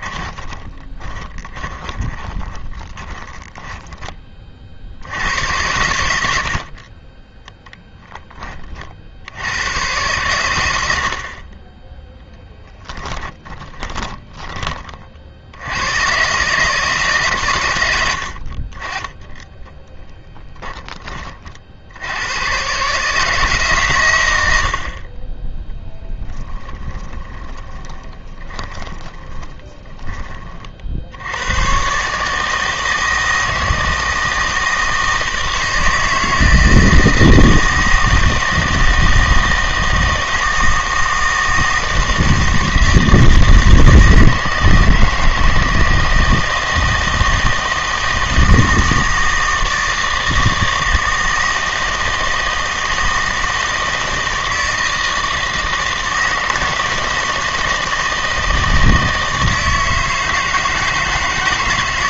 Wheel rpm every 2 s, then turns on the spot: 20, 20, 50, 50, 30, 90, 10, 30, 150, 40, 20, 130, 70, 10, 20, 40, 160, 160, 160, 160, 160, 160, 160, 160, 160, 160, 160, 160, 160, 160, 160.
0-4 12-14 20-22 26-30